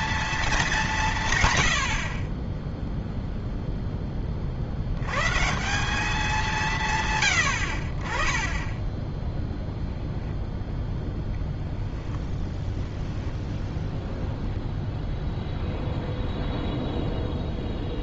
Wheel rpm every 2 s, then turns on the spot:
210, 10, 60, 170, 20, 0, 0, 0, 0.
none